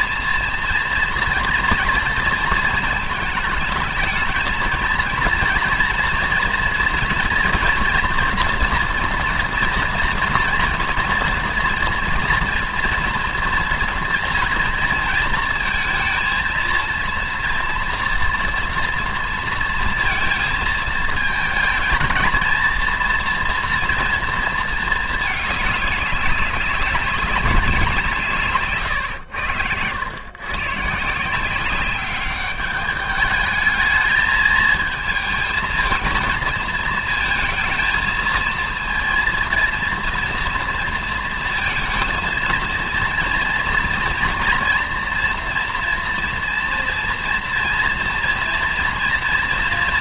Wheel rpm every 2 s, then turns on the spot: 230, 220, 230, 240, 240, 230, 230, 230, 230, 230, 220, 230, 220, 200, 130, 150, 210, 220, 220, 230, 230, 230, 230, 230, 230.
28-30